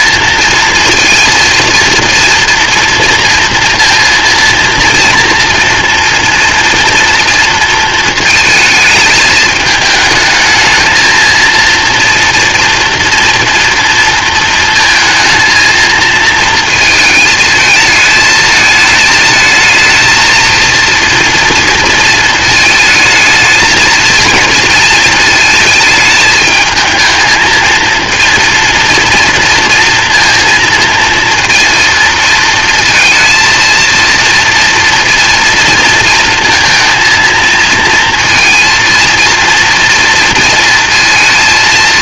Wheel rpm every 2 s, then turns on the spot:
230, 230, 230, 230, 220, 220, 230, 220, 230, 220, 230, 220, 230, 220, 230, 230, 230, 230, 230, 230, 230.
none